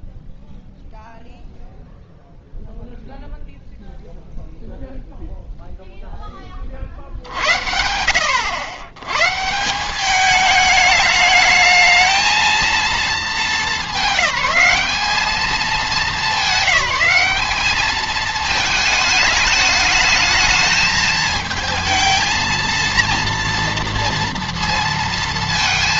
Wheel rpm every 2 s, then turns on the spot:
0, 0, 0, 60, 110, 210, 210, 210, 190, 220, 220, 230, 230.
none